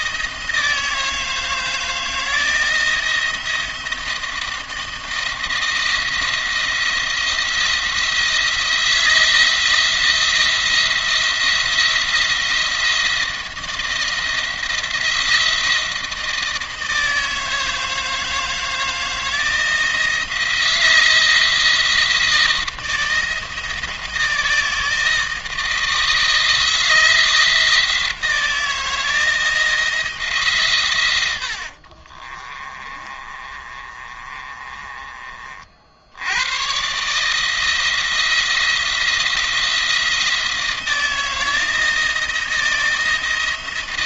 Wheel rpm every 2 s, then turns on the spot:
160, 160, 160, 170, 170, 170, 170, 170, 160, 160, 160, 160, 160, 170, 170, 120, 30, 30, 130, 170, 160, 170.
32-34